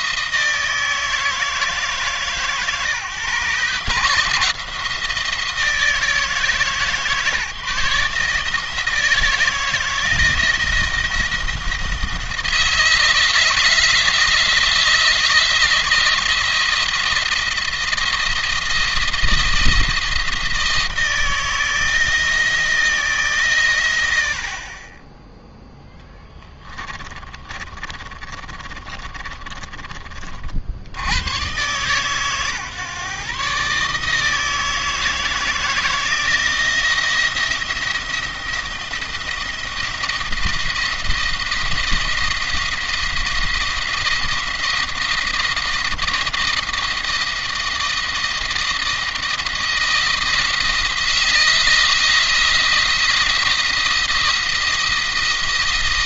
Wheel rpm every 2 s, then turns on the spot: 160, 150, 170, 160, 160, 170, 160, 160, 170, 170, 160, 160, 50, 30, 30, 70, 130, 160, 170, 170, 170, 170, 170, 170, 160, 160, 170, 170.
26-30